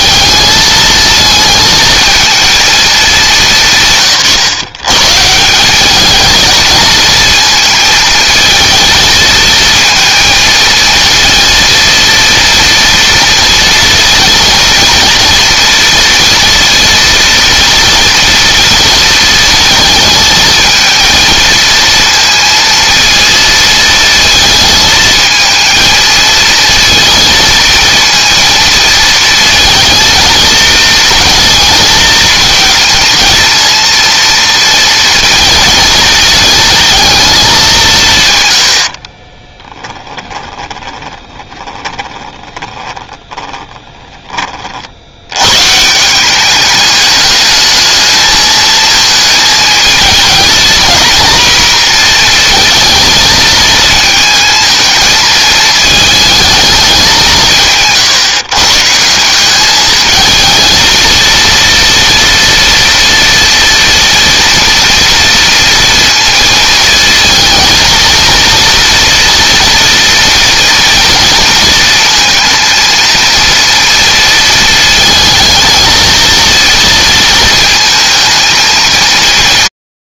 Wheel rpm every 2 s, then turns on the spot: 220, 220, 150, 220, 220, 230, 230, 230, 230, 230, 220, 230, 220, 230, 230, 230, 230, 230, 220, 80, 10, 20, 40, 200, 220, 230, 230, 220, 210, 150, 230, 240, 240, 230, 230, 230, 230, 230, 230, 230.
40-44